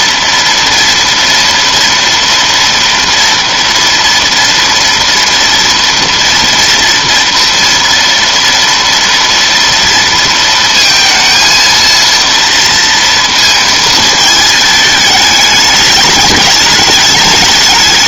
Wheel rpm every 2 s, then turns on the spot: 230, 230, 230, 230, 230, 230, 230, 220, 210.
none